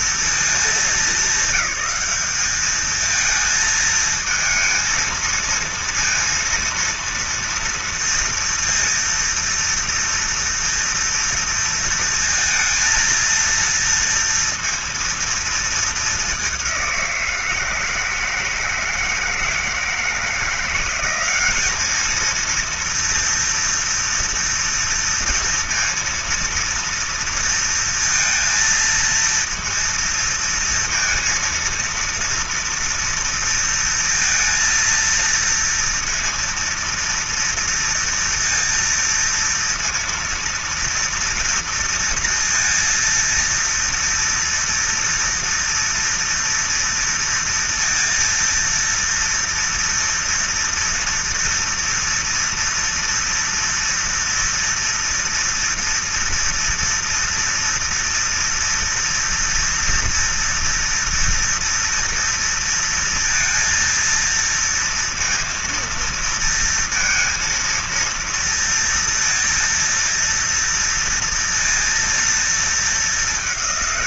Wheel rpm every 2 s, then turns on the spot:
220, 200, 220, 230, 230, 230, 230, 230, 210, 160, 160, 220, 240, 230, 230, 230, 230, 230, 230, 230, 230, 230, 230, 230, 230, 230, 230, 230, 230, 230, 230, 230, 230, 230, 230, 230, 230.
none